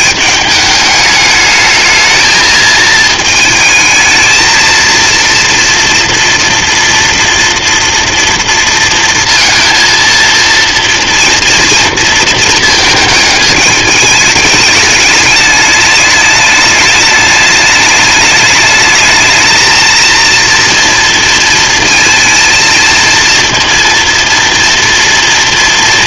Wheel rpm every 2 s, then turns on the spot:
210, 220, 230, 230, 230, 230, 230, 210, 210, 210, 240, 220, 230.
none